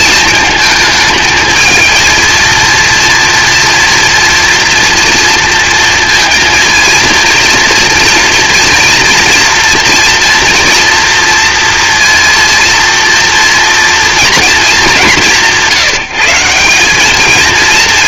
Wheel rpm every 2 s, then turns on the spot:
220, 230, 230, 230, 230, 230, 230, 210, 200.
none